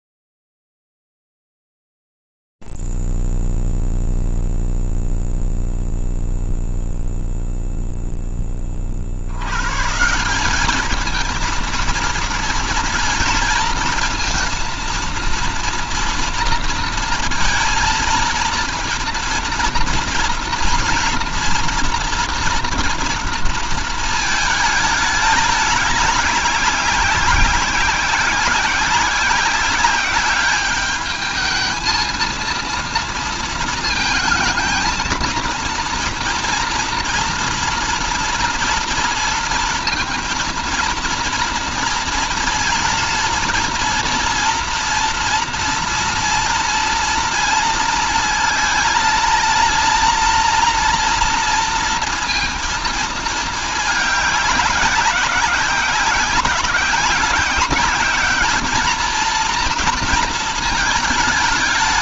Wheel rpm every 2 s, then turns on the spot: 0, 0, 0, 0, 0, 170, 230, 230, 230, 230, 230, 230, 220, 200, 190, 200, 230, 230, 230, 230, 230, 230, 230, 230, 220, 240, 230, 190, 190, 210, 220.
none